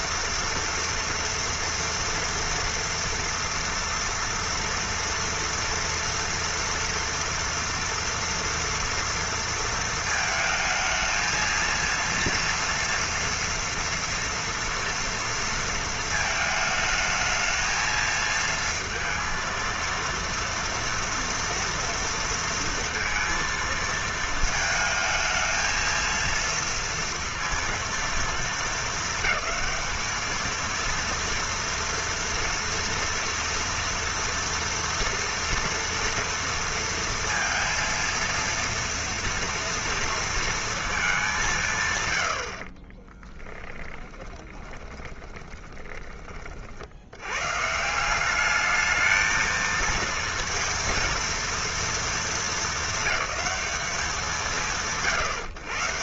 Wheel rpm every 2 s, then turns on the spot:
230, 230, 230, 230, 230, 220, 230, 230, 220, 230, 230, 230, 220, 230, 210, 230, 230, 230, 230, 230, 230, 50, 20, 50, 210, 230, 220, 130.
42-46